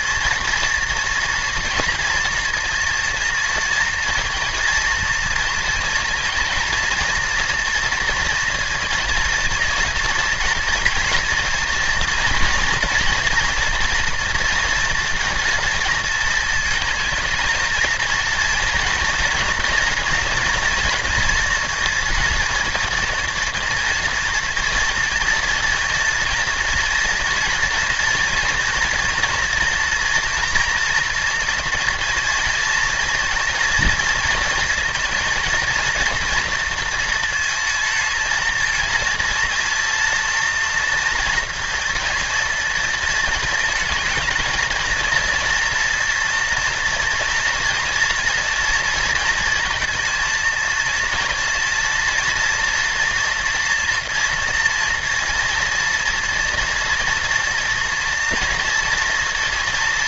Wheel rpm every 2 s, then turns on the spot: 230, 230, 230, 230, 230, 240, 230, 230, 220, 230, 240, 230, 230, 230, 240, 230, 230, 230, 230, 230, 230, 230, 220, 230, 230, 230, 230, 230, 240, 230.
none